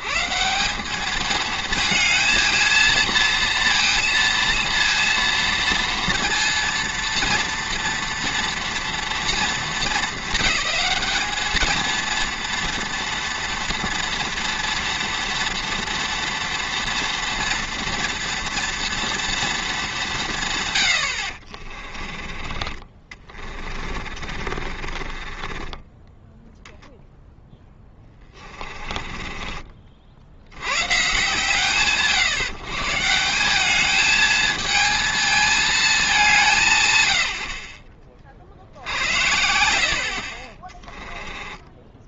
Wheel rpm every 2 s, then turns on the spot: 190, 230, 230, 230, 230, 220, 230, 240, 240, 230, 120, 30, 40, 0, 20, 60, 130, 220, 170, 60, 20.
24-26 28-30 40-42